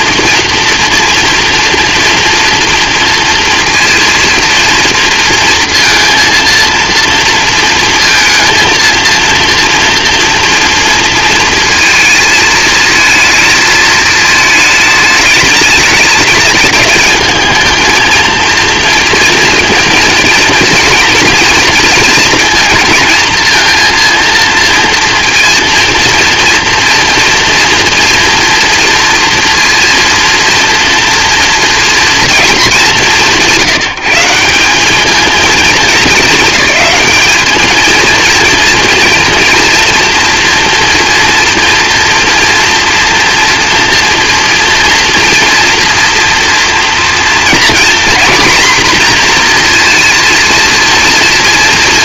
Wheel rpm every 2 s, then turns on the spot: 230, 230, 230, 230, 230, 230, 220, 220, 210, 230, 230, 220, 230, 230, 230, 230, 210, 190, 220, 230, 230, 230, 230, 240, 250, 230.
none